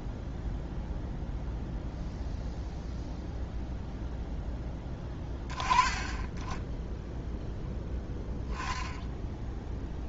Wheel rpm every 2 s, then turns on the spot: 0, 0, 10, 10, 0.
none